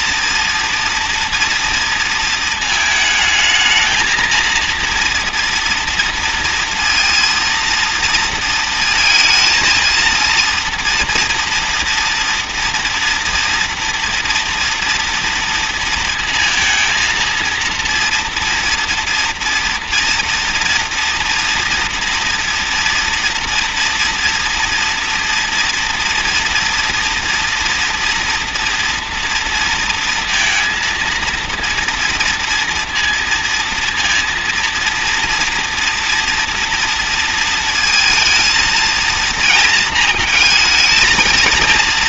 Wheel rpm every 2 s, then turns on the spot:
230, 230, 230, 230, 230, 230, 240, 240, 230, 240, 230, 230, 230, 230, 230, 230, 230, 230, 230, 230, 230.
none